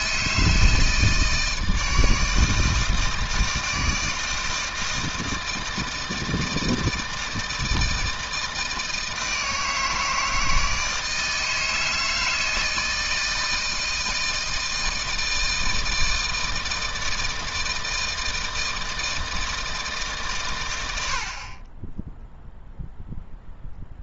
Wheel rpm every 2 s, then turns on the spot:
160, 160, 160, 160, 160, 160, 160, 160, 160, 160, 90, 0.
none